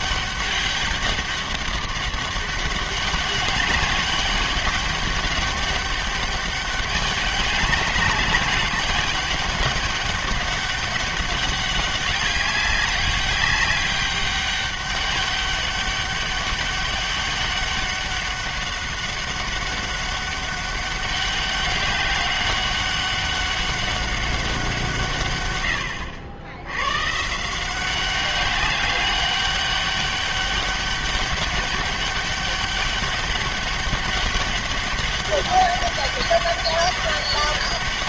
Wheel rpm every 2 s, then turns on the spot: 200, 200, 200, 200, 200, 200, 200, 200, 200, 200, 200, 190, 170, 110, 200, 200, 200, 200, 200.
none